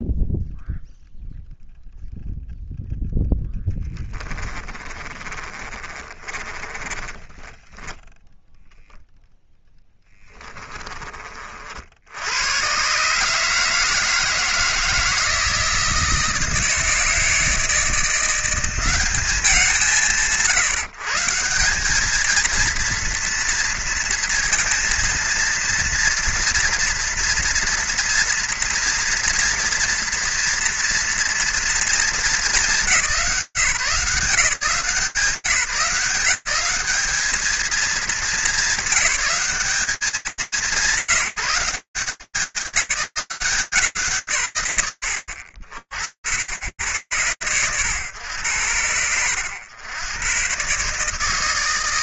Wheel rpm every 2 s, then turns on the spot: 0, 0, 20, 20, 0, 20, 120, 160, 160, 170, 140, 230, 230, 230, 240, 230, 210, 170, 190, 210, 160, 160, 50, 100, 90, 130.
4-8